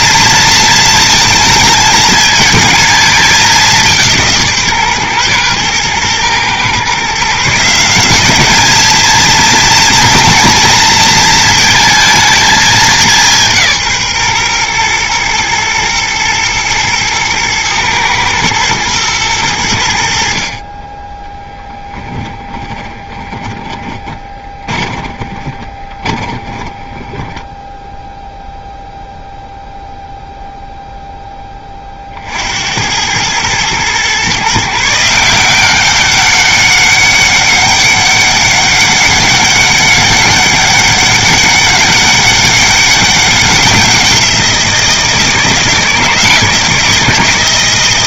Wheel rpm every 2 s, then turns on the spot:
230, 220, 150, 120, 210, 230, 210, 120, 110, 110, 30, 20, 20, 10, 0, 0, 70, 150, 200, 200, 200, 200, 170, 170.
22-28